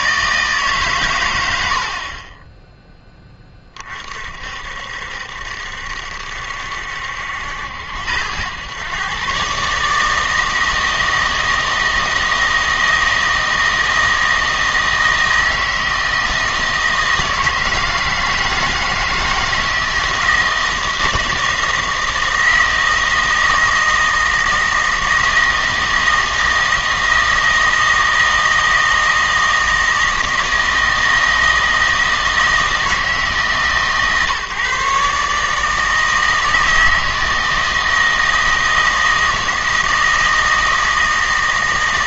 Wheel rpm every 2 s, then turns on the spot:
140, 10, 60, 70, 110, 160, 160, 160, 160, 160, 160, 160, 160, 160, 160, 160, 160, 140, 160, 160, 160.
none